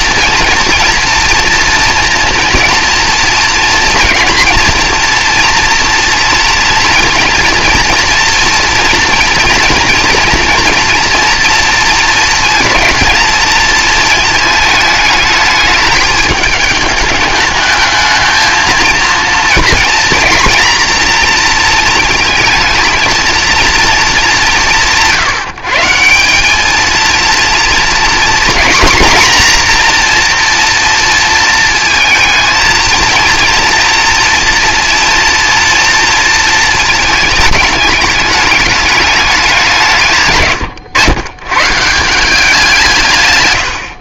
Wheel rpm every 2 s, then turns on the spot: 230, 240, 230, 230, 240, 230, 230, 220, 210, 230, 230, 230, 190, 210, 240, 240, 230, 240, 220, 210, 130, 180.
none